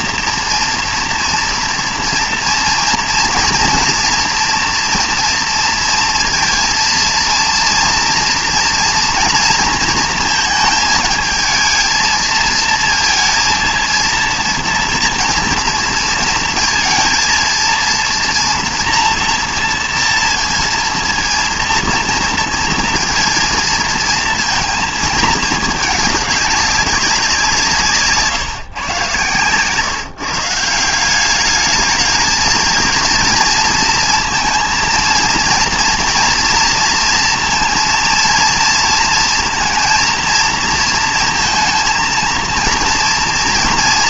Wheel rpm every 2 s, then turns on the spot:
230, 230, 230, 230, 230, 220, 230, 230, 230, 230, 230, 230, 230, 200, 130, 160, 220, 230, 230, 230, 230, 230.
none